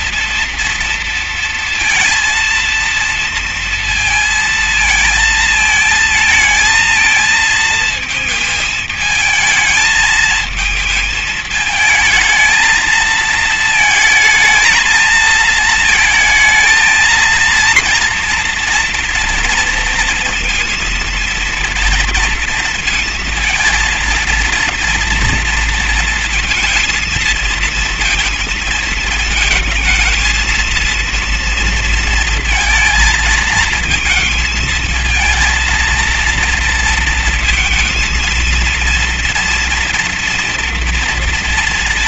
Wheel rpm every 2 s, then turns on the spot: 230, 230, 230, 220, 220, 220, 220, 220, 220, 230, 230, 230, 230, 230, 230, 230, 230, 220, 230, 230, 230.
none